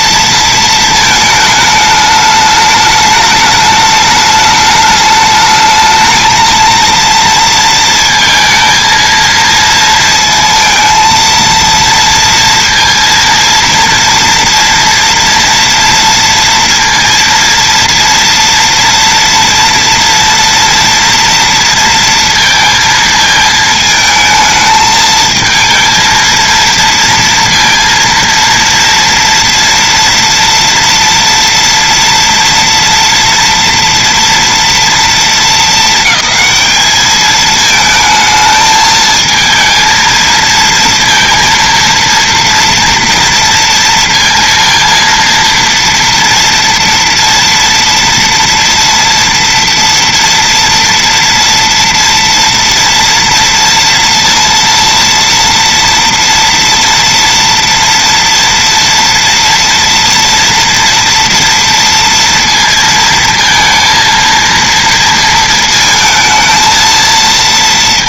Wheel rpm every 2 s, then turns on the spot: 230, 210, 210, 230, 230, 230, 230, 230, 230, 230, 230, 230, 220, 230, 230, 230, 230, 220, 210, 220, 230, 240, 230, 230, 230, 230, 230, 230, 230, 230, 230, 230, 230, 230.
none